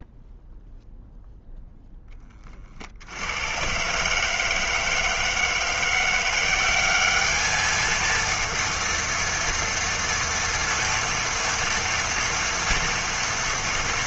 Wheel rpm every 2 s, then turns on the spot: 0, 40, 160, 190, 230, 230, 230.
none